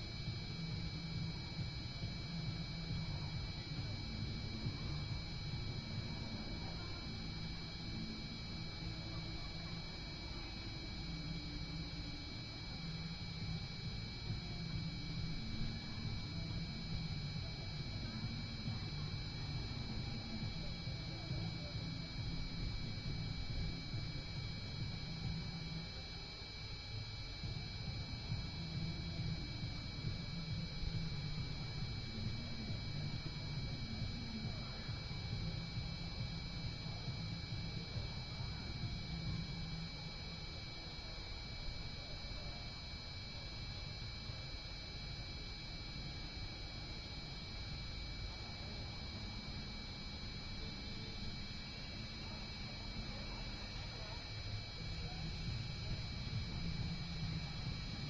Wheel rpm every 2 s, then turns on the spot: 0, 0, 0, 0, 0, 0, 0, 0, 0, 0, 0, 0, 0, 0, 0, 0, 0, 0, 0, 0, 0, 0, 0, 0, 0, 0, 0, 0, 0.
none